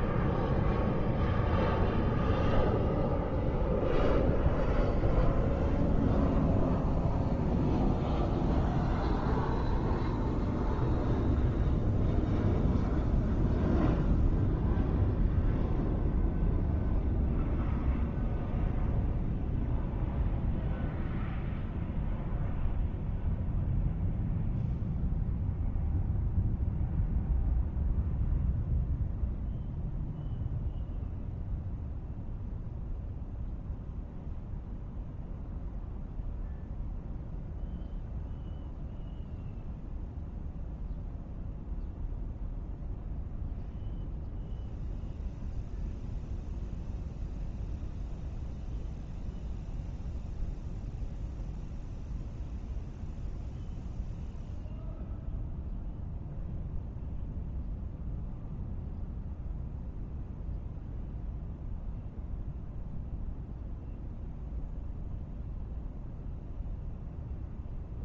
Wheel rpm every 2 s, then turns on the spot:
0, 0, 0, 0, 0, 0, 0, 0, 0, 0, 0, 0, 0, 0, 0, 0, 0, 0, 0, 0, 0, 0, 0, 0, 0, 0, 0, 0, 0, 0, 0, 0, 0, 0.
none